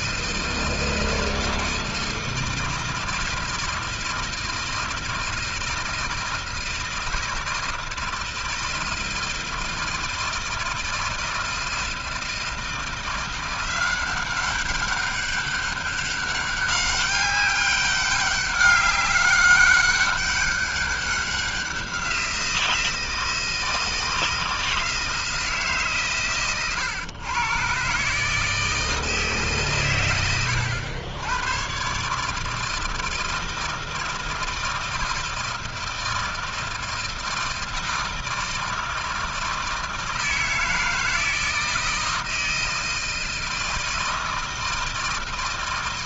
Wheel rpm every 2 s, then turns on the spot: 160, 160, 160, 160, 160, 160, 160, 190, 200, 200, 200, 170, 160, 110, 160, 100, 160, 160, 160, 160, 160, 160, 160.
none